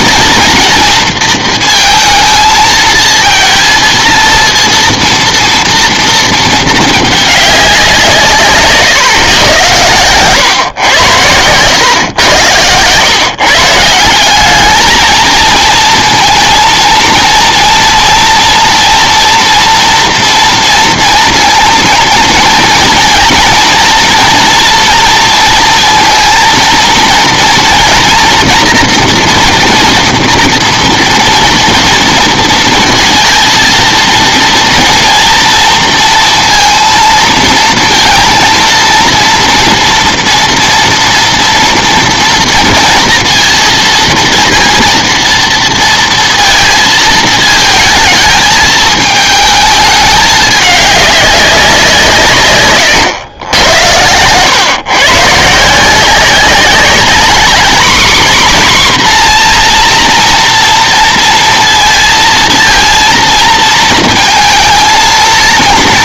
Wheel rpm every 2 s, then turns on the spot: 230, 220, 230, 220, 140, 120, 100, 200, 230, 240, 230, 230, 230, 230, 240, 240, 230, 230, 230, 230, 230, 230, 230, 230, 210, 200, 130, 120, 190, 260, 230, 220, 230.
8-10 52-54